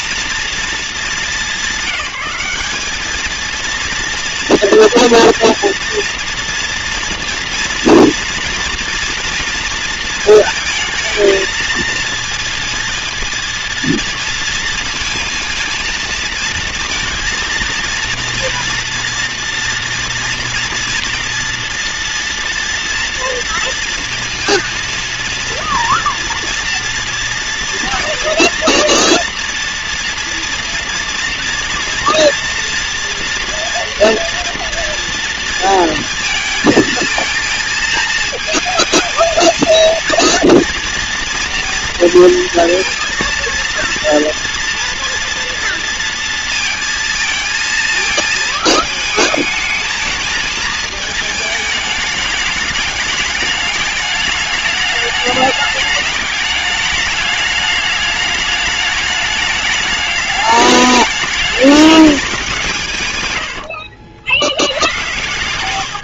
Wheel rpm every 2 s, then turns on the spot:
200, 230, 240, 230, 230, 230, 230, 230, 230, 230, 230, 230, 230, 230, 230, 230, 240, 230, 230, 230, 230, 230, 230, 230, 220, 220, 220, 210, 210, 210, 210, 100, 130.
62-66